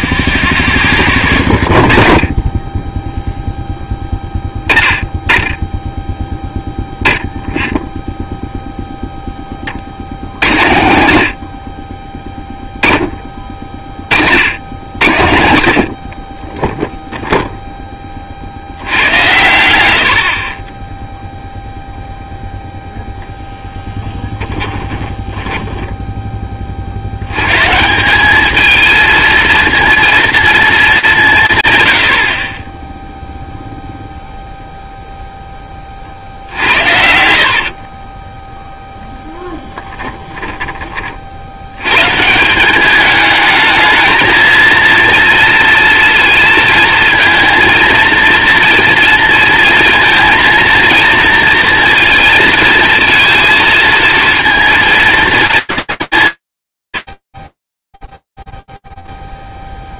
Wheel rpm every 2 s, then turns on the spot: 0, 0, 10, 0, 0, 90, 10, 80, 10, 80, 10, 0, 10, 40, 220, 210, 20, 0, 70, 0, 40, 210, 230, 230, 230, 230, 230, 230, 100, 0.
12-14 24-26 36-38